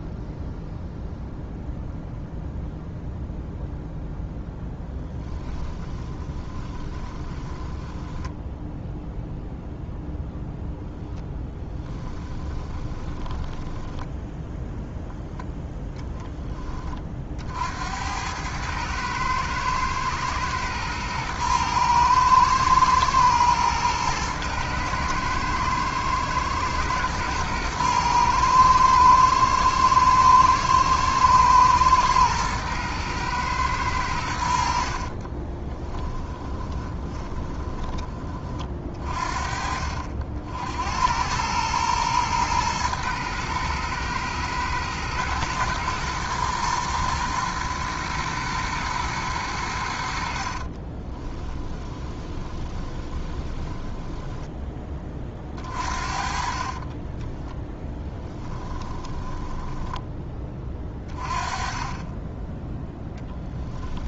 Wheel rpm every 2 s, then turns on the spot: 0, 0, 10, 20, 0, 0, 20, 0, 30, 110, 110, 110, 110, 120, 120, 110, 110, 50, 20, 50, 80, 120, 120, 120, 120, 30, 20, 20, 30, 20, 20, 10.
4-8 12-14 34-38 50-54 56-60